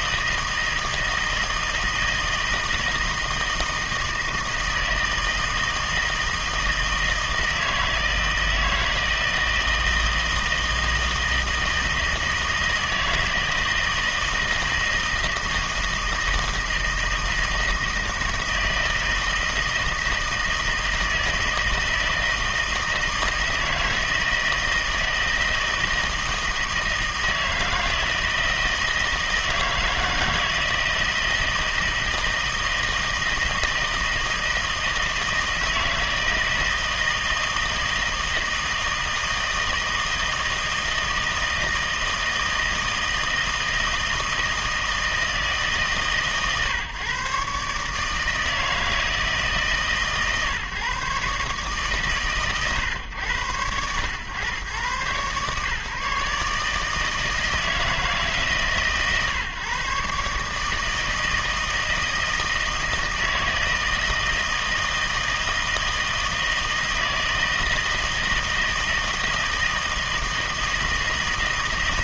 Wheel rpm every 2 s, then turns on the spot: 160, 160, 160, 160, 160, 160, 160, 160, 160, 160, 160, 160, 160, 160, 160, 160, 160, 160, 160, 160, 160, 160, 160, 140, 160, 140, 120, 120, 150, 140, 150, 160, 160, 160, 160, 160.
none